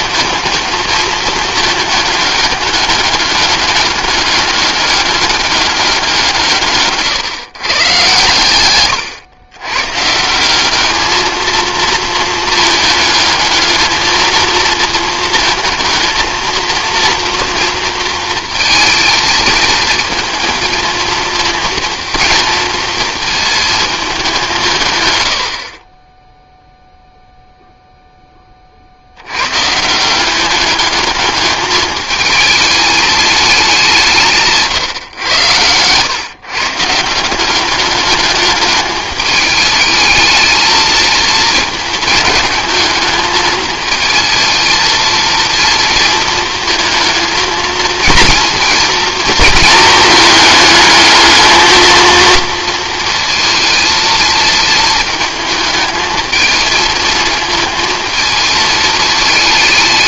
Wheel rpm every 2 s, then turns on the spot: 220, 210, 200, 150, 120, 200, 220, 230, 230, 230, 230, 230, 150, 0, 40, 210, 220, 140, 150, 210, 220, 220, 220, 220, 230, 220, 230, 220, 230, 220.
none